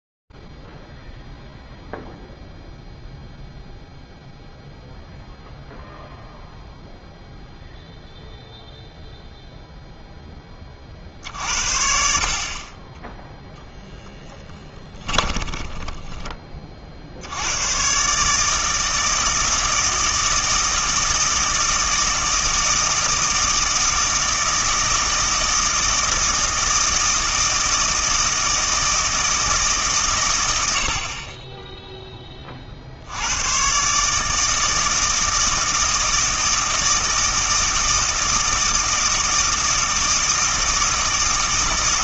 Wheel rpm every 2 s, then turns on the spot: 0, 0, 0, 0, 0, 40, 20, 20, 60, 160, 160, 160, 160, 160, 160, 40, 100, 160, 160, 160, 160.
14-16